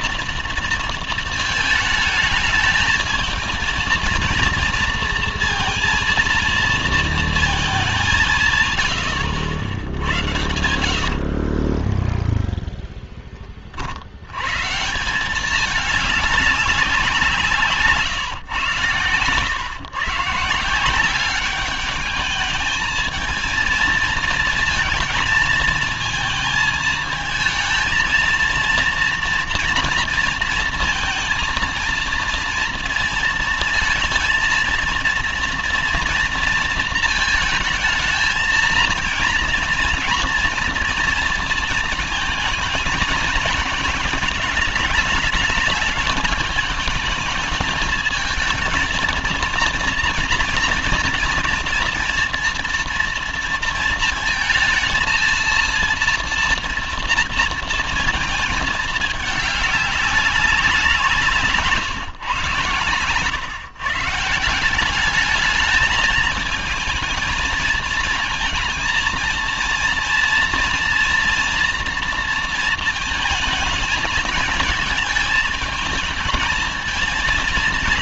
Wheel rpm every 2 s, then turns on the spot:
230, 210, 230, 230, 160, 90, 10, 120, 200, 130, 170, 220, 230, 230, 230, 230, 230, 230, 230, 230, 230, 220, 200, 210, 220, 230, 230, 230, 230, 220, 200, 120, 160, 220, 230, 230, 230, 220, 220.
10-14